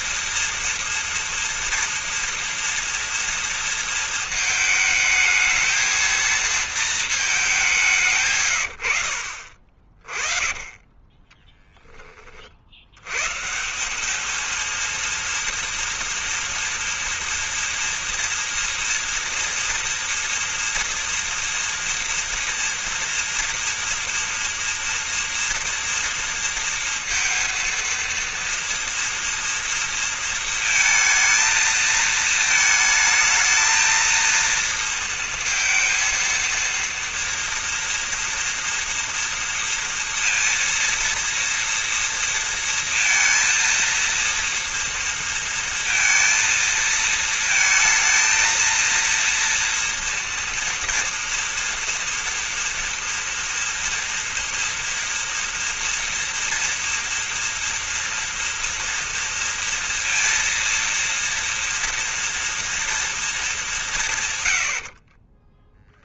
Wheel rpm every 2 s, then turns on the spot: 230, 230, 220, 230, 130, 20, 40, 220, 240, 230, 240, 230, 230, 230, 230, 230, 220, 230, 230, 230, 230, 230, 230, 230, 230, 230, 230, 230, 230, 230, 230, 230, 60.
10-12 64-66